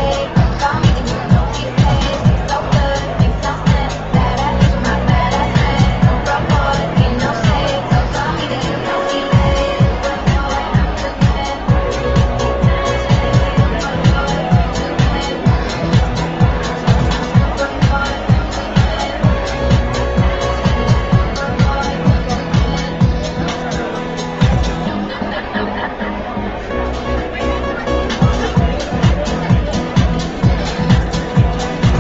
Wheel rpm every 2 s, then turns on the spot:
0, 0, 0, 0, 0, 0, 0, 0, 0, 0, 0, 0, 0, 0, 0, 0.
none